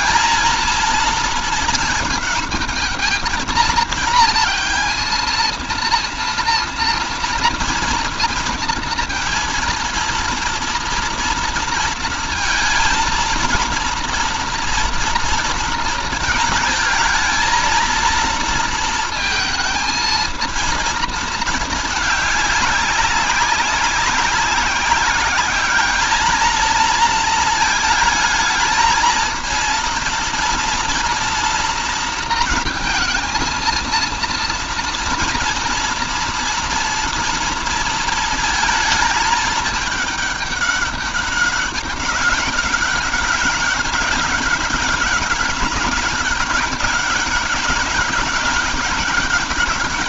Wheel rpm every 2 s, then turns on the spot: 230, 210, 230, 230, 230, 230, 230, 230, 220, 230, 230, 200, 190, 220, 220, 230, 230, 230, 230, 230, 200, 190, 200, 200, 200.
none